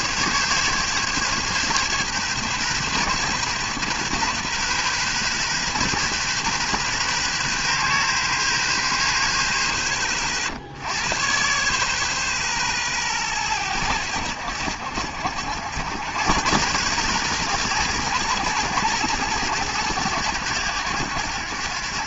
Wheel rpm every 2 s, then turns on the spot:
140, 130, 130, 130, 110, 80, 120, 70, 120, 110, 90.
none